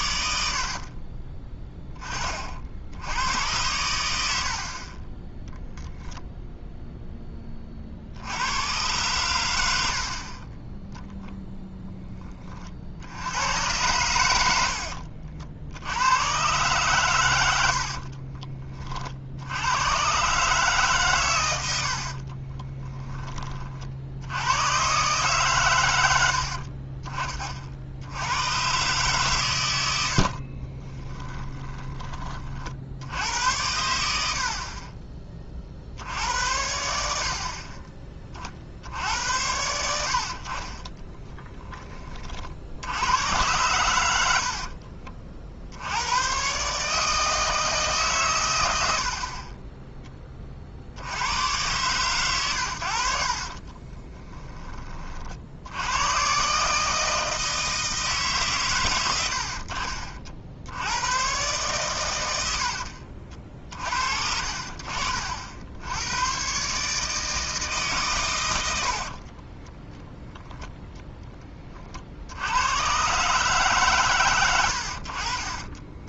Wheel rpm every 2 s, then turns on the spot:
50, 50, 60, 0, 100, 10, 30, 80, 130, 30, 140, 20, 90, 40, 110, 40, 50, 50, 80, 40, 40, 60, 60, 130, 110, 50, 100, 20, 140, 140, 80, 70, 50, 130, 90, 0, 90, 90.
0-2 4-6 14-16 22-24 26-28 30-32 62-64